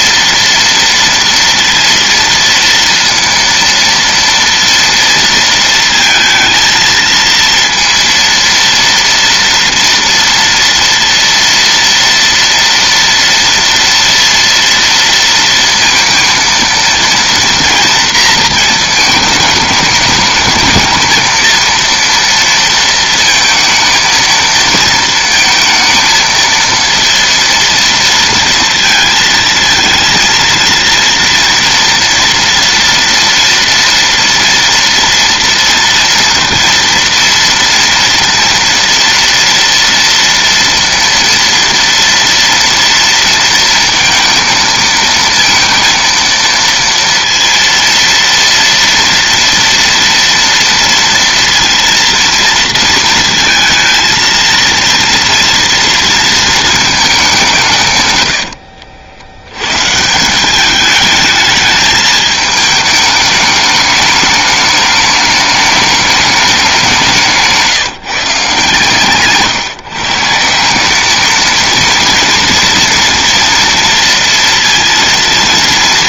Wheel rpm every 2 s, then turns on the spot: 230, 230, 230, 230, 230, 230, 230, 230, 230, 220, 230, 230, 230, 230, 230, 230, 230, 230, 230, 230, 230, 230, 230, 230, 230, 230, 220, 230, 210, 70, 210, 210, 210, 170, 140, 220, 230, 230.
none